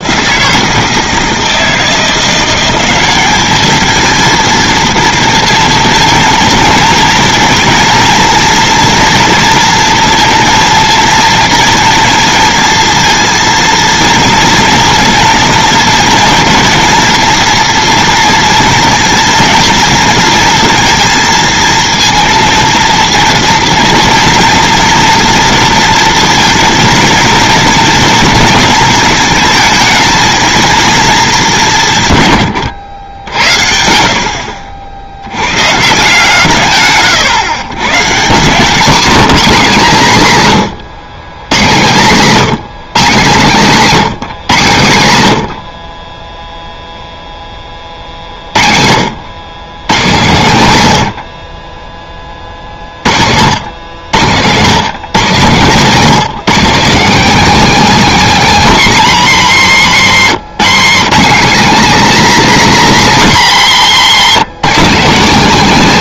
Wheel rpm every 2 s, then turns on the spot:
160, 180, 230, 230, 230, 230, 230, 230, 230, 230, 230, 230, 230, 230, 220, 220, 110, 60, 140, 180, 150, 180, 120, 0, 50, 120, 40, 130, 220, 240, 180, 250, 180.
none